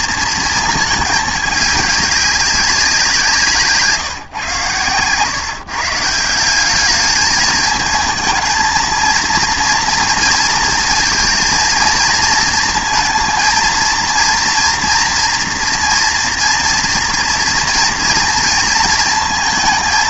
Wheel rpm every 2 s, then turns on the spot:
220, 190, 110, 190, 220, 230, 230, 230, 230, 230.
none